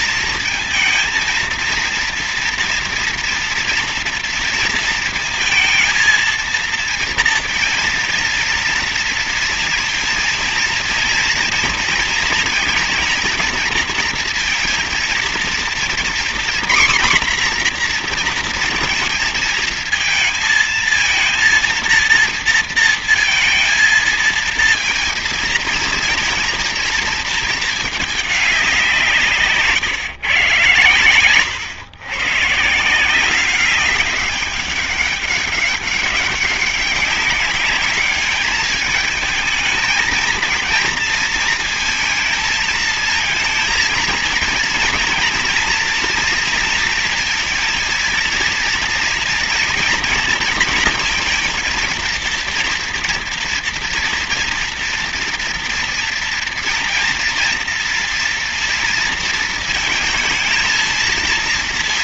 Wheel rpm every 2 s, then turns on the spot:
230, 230, 230, 230, 230, 230, 230, 230, 240, 230, 220, 230, 230, 230, 190, 130, 160, 200, 200, 210, 230, 230, 230, 230, 230, 230, 230, 230, 230, 230, 230.
none